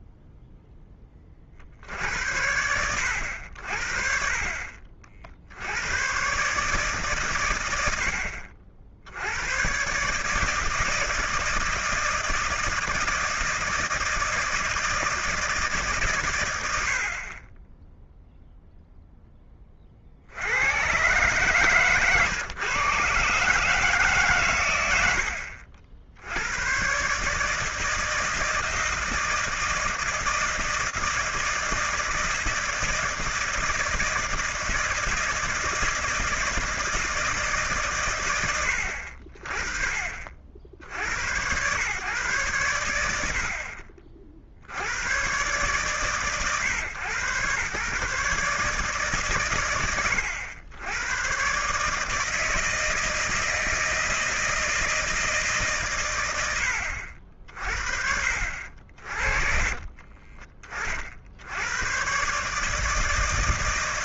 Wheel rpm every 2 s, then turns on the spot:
10, 80, 40, 140, 60, 160, 170, 160, 90, 0, 100, 130, 110, 100, 160, 160, 160, 160, 160, 80, 60, 120, 60, 120, 150, 100, 160, 160, 80, 60, 40, 150.
none